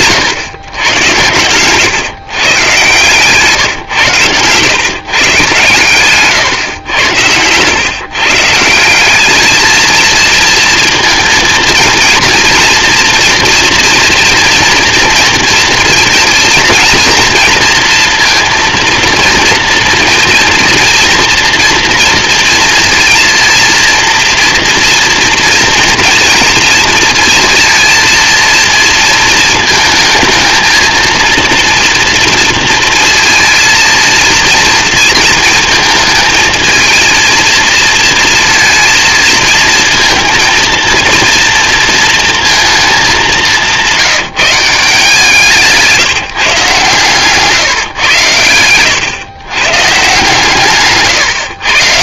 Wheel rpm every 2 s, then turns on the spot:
150, 130, 150, 120, 110, 220, 230, 240, 230, 230, 230, 230, 230, 230, 230, 230, 230, 230, 220, 230, 230, 230, 180, 160, 130, 120.
44-46